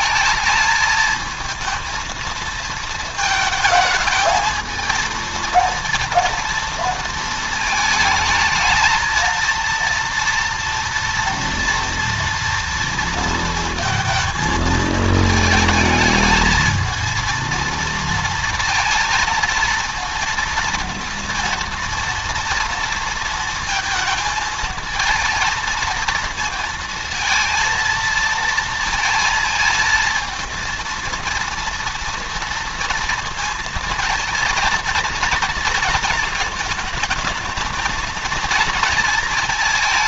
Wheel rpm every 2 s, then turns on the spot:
220, 220, 220, 230, 220, 230, 230, 220, 220, 230, 230, 230, 220, 230, 230, 230, 230, 230, 220, 230.
none